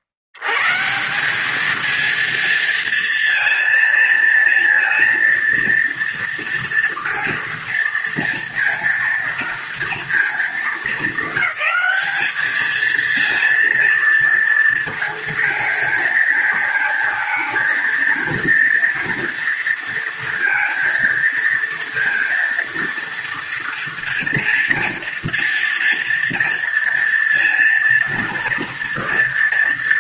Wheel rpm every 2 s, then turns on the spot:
80, 230, 230, 230, 230, 230, 220, 230, 220, 230, 230, 230, 230, 230, 230.
none